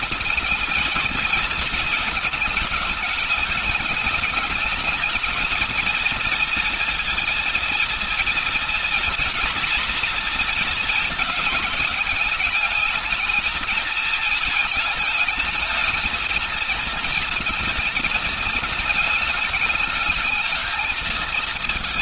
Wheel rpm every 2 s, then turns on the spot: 220, 210, 220, 230, 240, 240, 220, 220, 220, 220, 220.
none